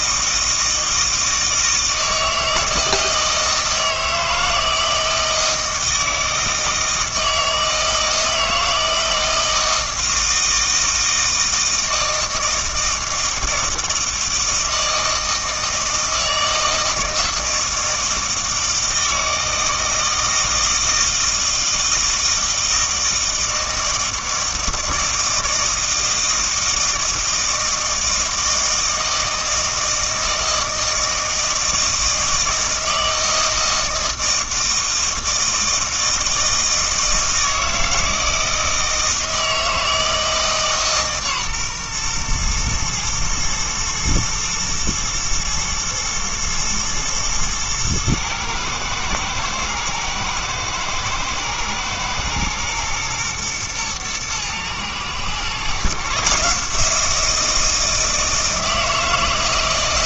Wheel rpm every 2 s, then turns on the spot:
160, 160, 160, 160, 160, 160, 160, 160, 160, 160, 160, 160, 160, 160, 160, 160, 160, 160, 160, 160, 150, 120, 110, 110, 110, 110, 120, 120, 160, 160.
none